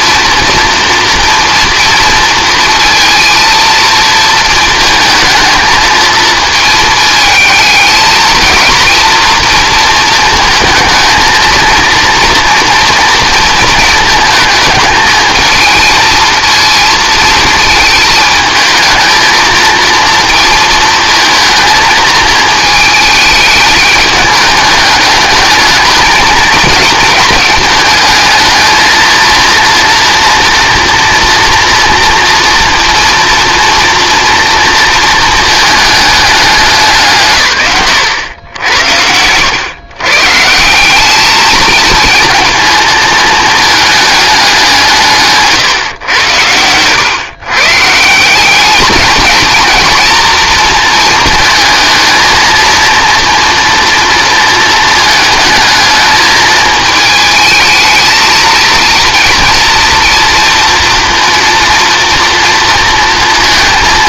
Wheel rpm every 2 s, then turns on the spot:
230, 230, 220, 220, 220, 230, 230, 220, 230, 220, 230, 220, 210, 220, 220, 230, 230, 230, 190, 90, 170, 230, 190, 100, 200, 230, 230, 220, 220, 220, 230, 230.
none